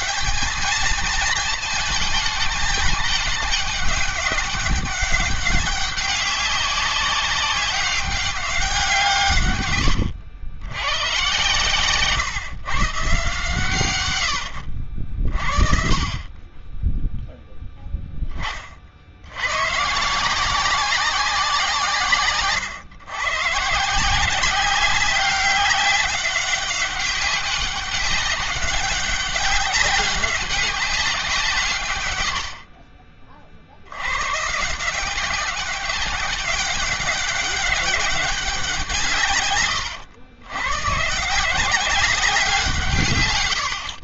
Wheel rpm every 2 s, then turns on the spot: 220, 210, 200, 190, 180, 100, 130, 80, 20, 40, 180, 130, 190, 190, 200, 200, 50, 150, 200, 190, 110, 170.
none